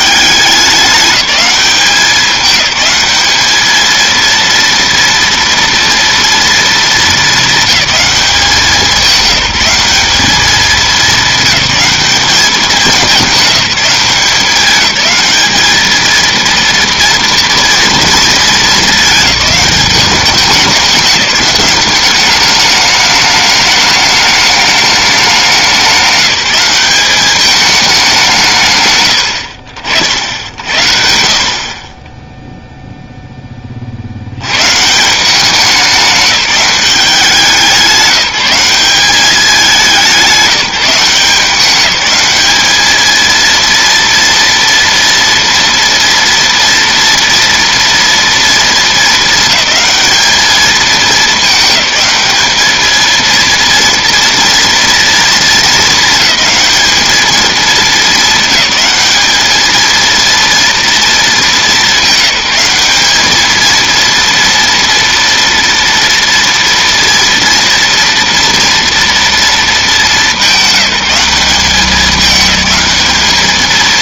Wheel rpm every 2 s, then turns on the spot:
200, 210, 230, 220, 190, 200, 210, 210, 230, 220, 200, 210, 210, 200, 120, 60, 0, 140, 200, 190, 180, 220, 230, 230, 210, 220, 220, 230, 220, 210, 230, 200, 230, 230, 240, 200, 210.
none